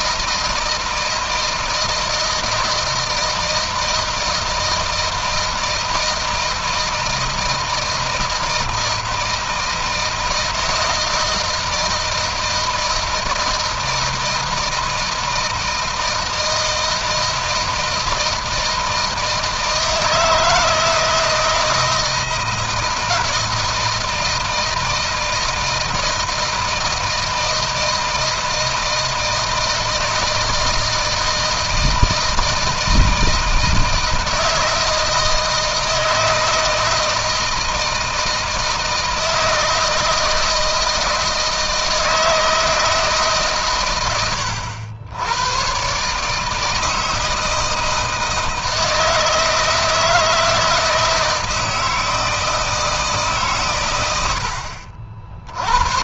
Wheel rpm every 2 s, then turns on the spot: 160, 160, 160, 160, 160, 160, 160, 160, 160, 160, 160, 160, 160, 160, 160, 160, 160, 160, 160, 160, 170, 160, 100, 160, 160, 160, 150, 50.
none